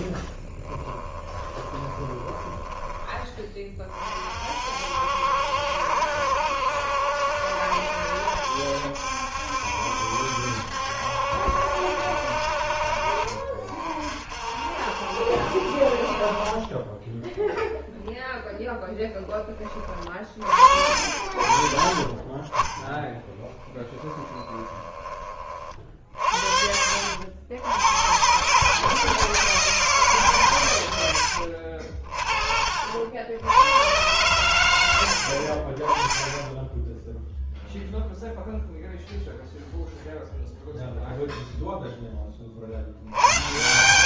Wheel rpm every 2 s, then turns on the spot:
10, 20, 50, 70, 70, 70, 60, 50, 30, 0, 40, 20, 10, 60, 140, 130, 40, 100, 10, 0, 0, 40.
0-4 20-22 24-26